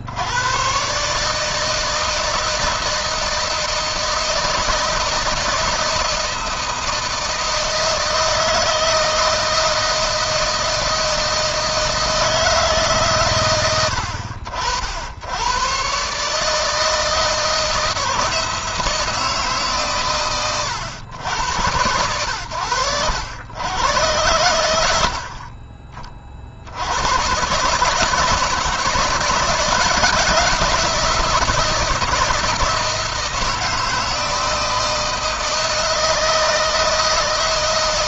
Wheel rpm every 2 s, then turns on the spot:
140, 160, 160, 160, 160, 160, 140, 70, 160, 160, 100, 100, 90, 100, 160, 170, 160, 160, 160.
none